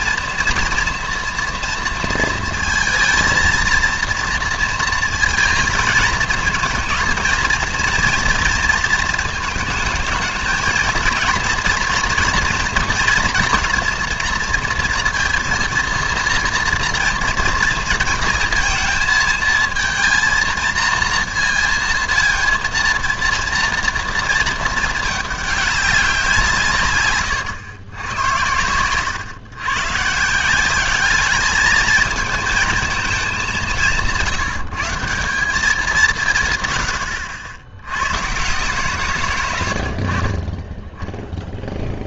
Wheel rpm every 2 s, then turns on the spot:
230, 230, 230, 230, 230, 220, 230, 230, 230, 230, 230, 230, 220, 160, 100, 180, 220, 170, 130, 140, 20.
none